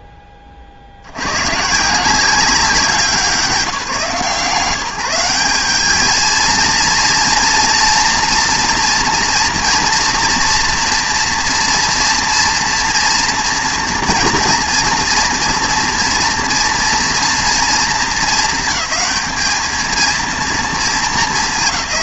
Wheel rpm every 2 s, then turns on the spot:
50, 180, 160, 230, 230, 230, 240, 230, 230, 200, 220.
none